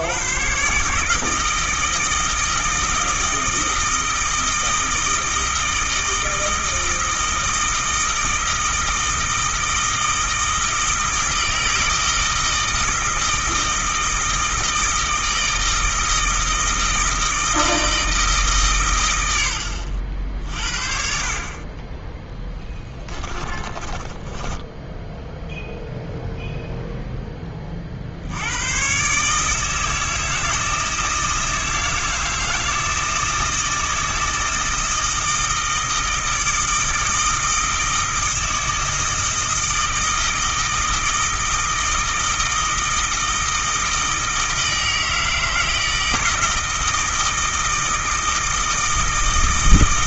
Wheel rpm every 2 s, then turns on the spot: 140, 160, 160, 160, 160, 160, 160, 160, 160, 120, 50, 20, 10, 0, 120, 160, 160, 160, 160, 160, 160, 160, 160, 160, 160.
22-26